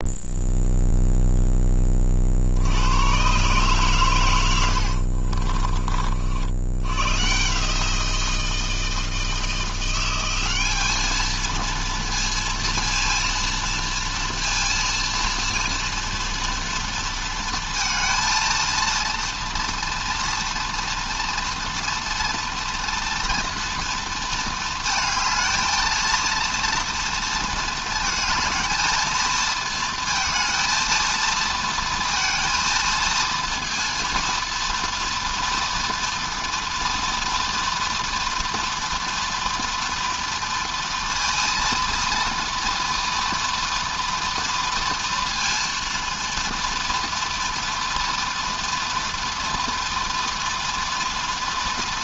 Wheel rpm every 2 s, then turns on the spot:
0, 50, 100, 70, 170, 190, 230, 230, 230, 230, 230, 240, 230, 230, 220, 230, 230, 230, 240, 240, 230, 230, 230, 230, 240, 230.
none